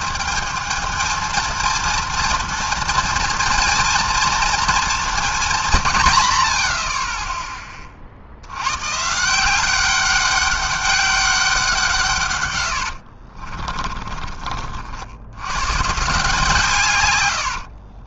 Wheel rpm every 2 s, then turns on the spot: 220, 230, 230, 90, 90, 200, 120, 40, 150.
none